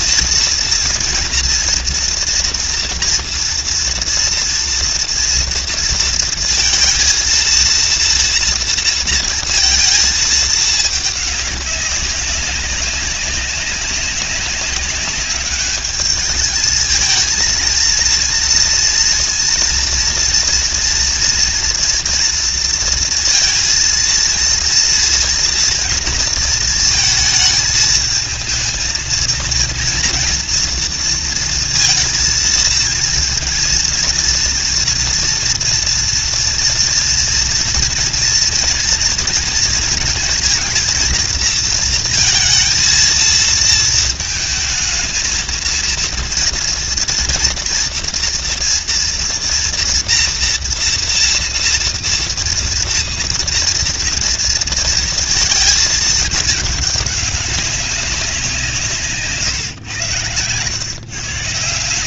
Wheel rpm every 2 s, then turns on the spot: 240, 230, 230, 230, 230, 210, 200, 200, 220, 230, 230, 230, 230, 220, 220, 230, 230, 240, 230, 230, 230, 230, 220, 230, 230, 230, 230, 230, 200, 150, 150.
none